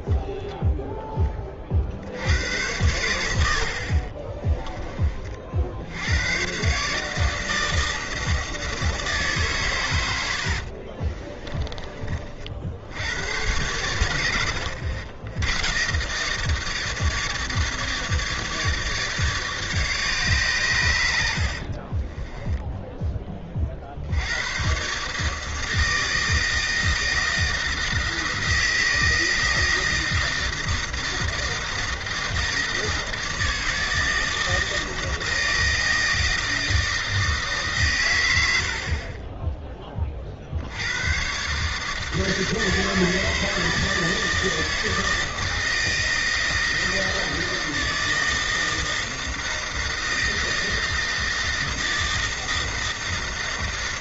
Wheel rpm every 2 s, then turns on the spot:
0, 100, 20, 130, 160, 60, 60, 90, 150, 150, 130, 10, 110, 160, 160, 160, 160, 160, 160, 70, 70, 160, 160, 160, 160, 160, 160.
10-12 22-24 38-40